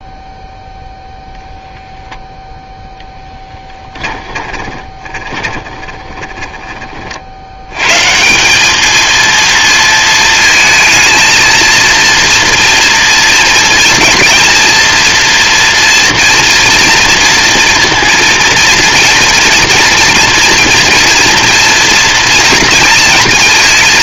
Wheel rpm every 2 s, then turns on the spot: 0, 0, 20, 30, 210, 230, 230, 230, 230, 230, 230, 230.
4-6